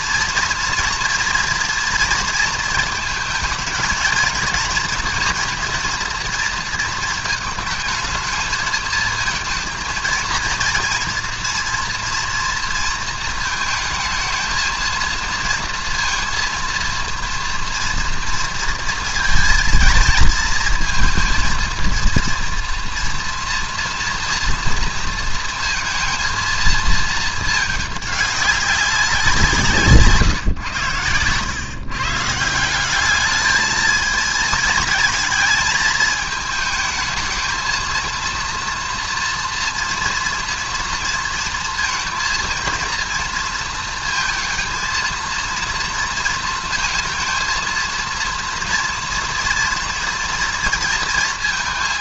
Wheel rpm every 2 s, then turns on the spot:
230, 230, 220, 230, 220, 230, 230, 220, 230, 230, 230, 230, 230, 230, 200, 140, 140, 220, 220, 230, 230, 230, 220, 230, 230, 230.
none